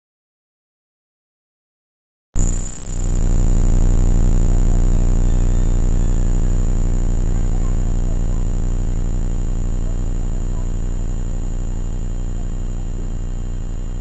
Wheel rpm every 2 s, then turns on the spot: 0, 0, 0, 0, 0, 0, 0.
none